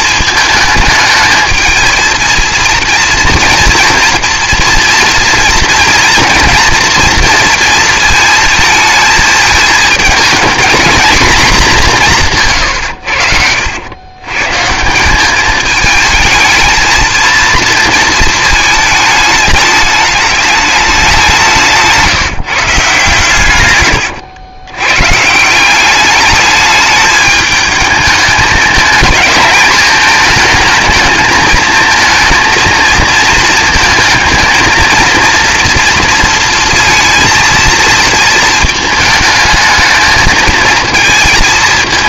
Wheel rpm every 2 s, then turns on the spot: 220, 230, 230, 230, 230, 220, 130, 150, 220, 220, 210, 150, 120, 210, 220, 220, 220, 230, 230, 220, 220.
none